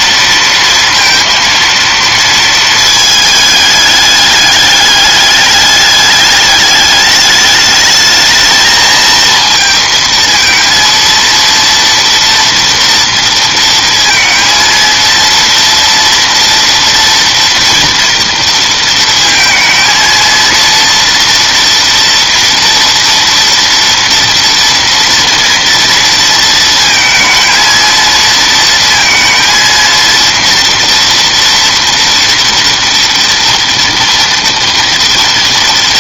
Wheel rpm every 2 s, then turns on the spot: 230, 220, 210, 210, 220, 230, 230, 230, 230, 230, 230, 230, 230, 230, 230, 230, 230, 230.
none